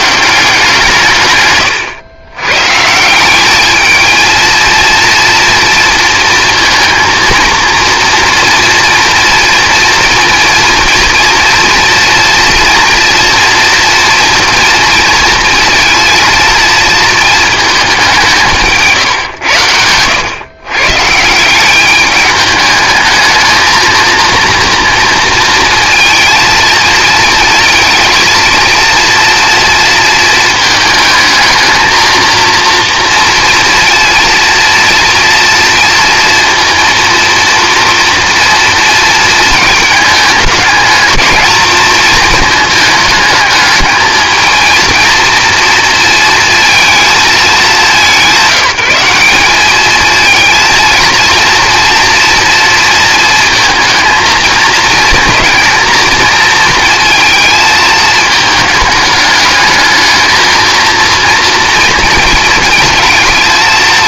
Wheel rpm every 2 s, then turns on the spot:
160, 150, 230, 230, 240, 230, 230, 230, 230, 150, 130, 210, 230, 230, 230, 230, 240, 230, 230, 230, 220, 220, 230, 230, 190, 230, 230, 220, 230, 220, 230, 220.
none